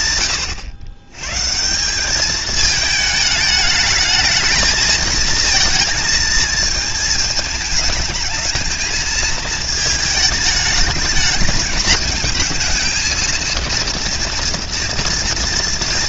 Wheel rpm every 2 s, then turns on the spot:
110, 220, 230, 210, 220, 220, 230, 240.
none